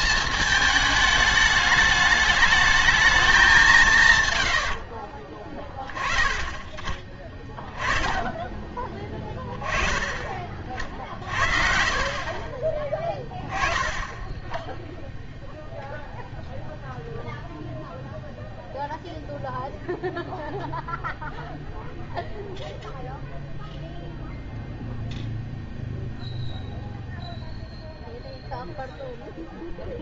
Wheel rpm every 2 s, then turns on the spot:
220, 210, 90, 20, 10, 30, 30, 10, 0, 0, 0, 0, 0, 0, 0.
6-8